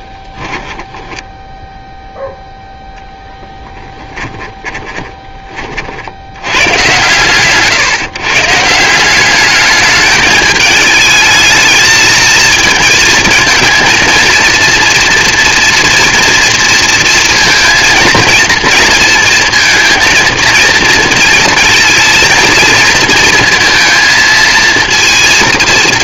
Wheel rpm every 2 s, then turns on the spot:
10, 0, 20, 110, 160, 220, 230, 230, 230, 230, 230, 230, 230.
0-2 4-6